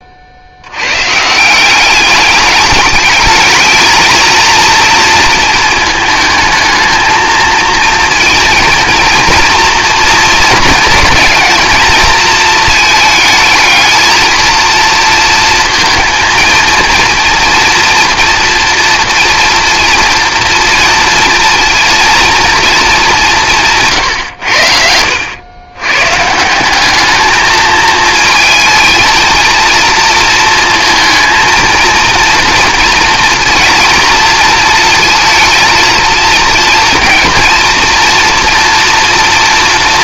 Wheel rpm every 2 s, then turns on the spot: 90, 210, 230, 220, 230, 220, 220, 230, 230, 230, 230, 220, 90, 180, 220, 220, 230, 230, 230, 240.
none